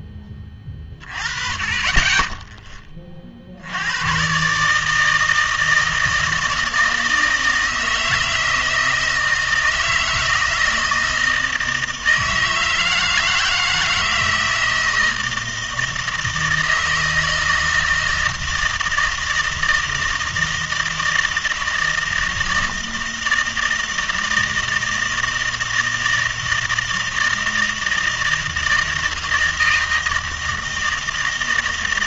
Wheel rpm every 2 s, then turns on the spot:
30, 20, 150, 160, 160, 160, 160, 160, 160, 160, 160, 160, 160, 160, 160, 160.
none